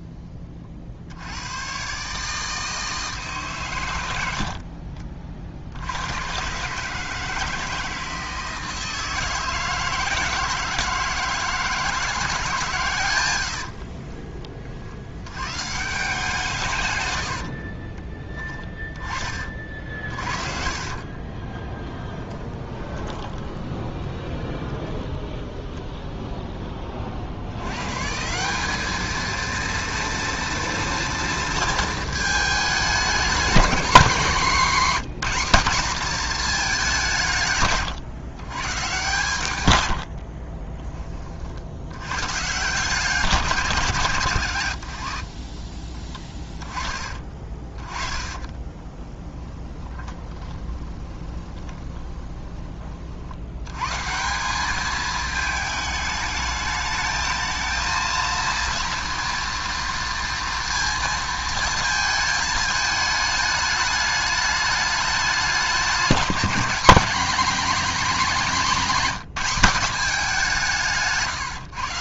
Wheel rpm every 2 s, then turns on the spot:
30, 160, 60, 150, 160, 160, 140, 50, 150, 20, 40, 20, 10, 20, 200, 230, 210, 200, 200, 130, 20, 150, 110, 20, 20, 20, 40, 200, 220, 230, 230, 220, 210, 200, 210, 150.
4-6 20-24 48-52 70-72